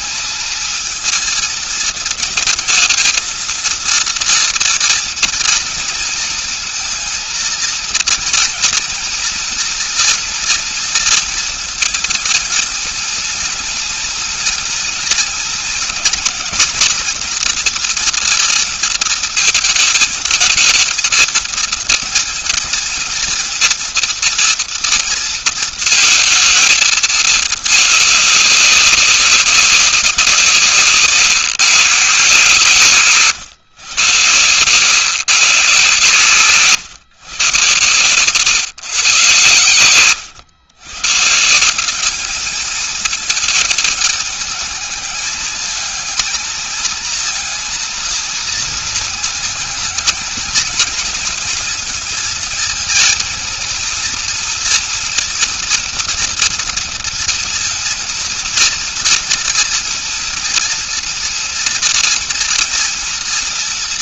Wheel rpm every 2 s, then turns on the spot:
220, 230, 230, 230, 230, 230, 230, 230, 240, 230, 220, 230, 230, 230, 200, 180, 150, 120, 130, 120, 120, 210, 220, 220, 230, 230, 230, 230, 230, 220, 230, 230.
none